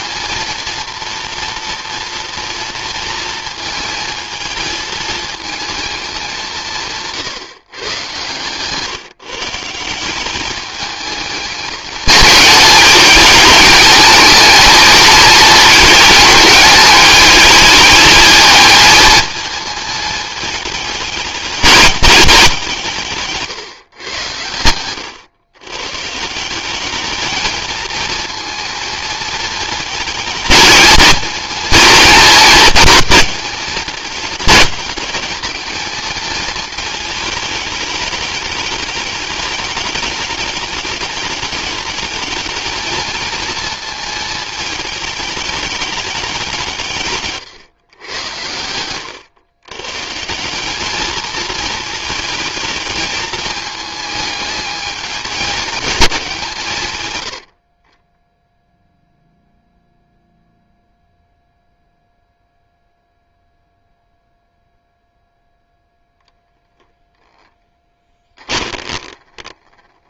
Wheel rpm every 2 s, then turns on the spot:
230, 230, 220, 160, 150, 210, 210, 220, 210, 220, 210, 170, 100, 200, 230, 220, 220, 210, 220, 210, 210, 220, 220, 160, 100, 210, 220, 210, 120, 0, 0, 0, 0, 10, 20.
68-70